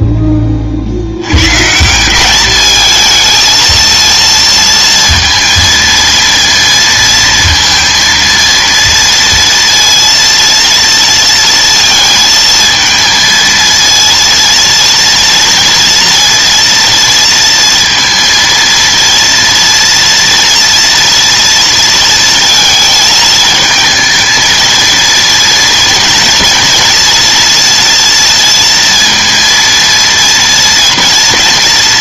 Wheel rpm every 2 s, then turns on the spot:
30, 210, 230, 230, 230, 230, 230, 230, 230, 230, 240, 220, 220, 230, 230, 230.
none